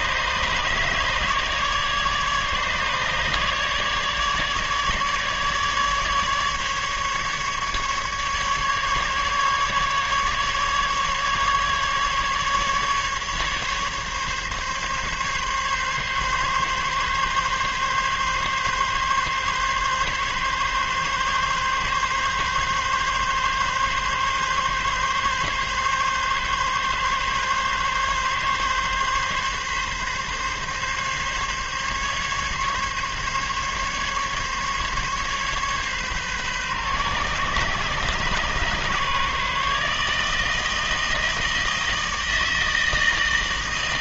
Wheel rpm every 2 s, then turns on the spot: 150, 150, 150, 150, 150, 150, 140, 140, 140, 140, 140, 140, 140, 140, 140, 140, 140, 140, 130, 140, 160, 160.
none